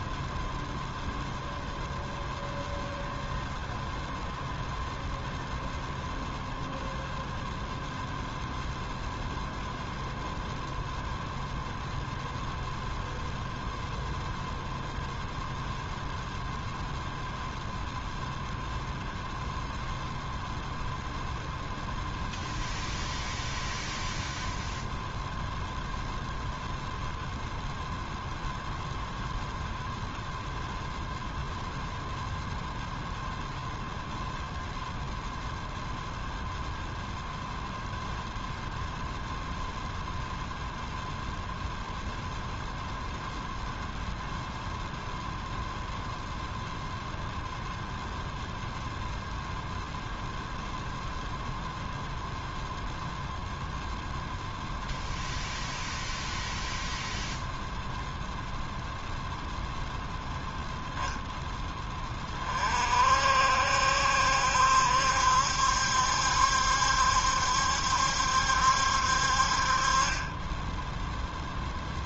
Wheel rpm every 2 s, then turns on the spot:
0, 0, 0, 0, 0, 0, 0, 0, 0, 0, 0, 0, 0, 0, 0, 0, 0, 0, 0, 0, 0, 0, 0, 0, 0, 0, 0, 0, 0, 0, 0, 40, 70, 70, 70, 10.
70-72